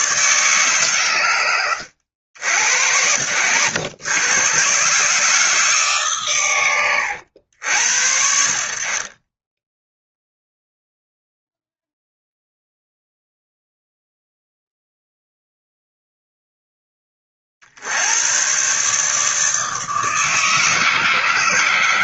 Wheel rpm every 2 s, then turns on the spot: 130, 70, 140, 100, 40, 0, 0, 0, 10, 130, 150.
6-8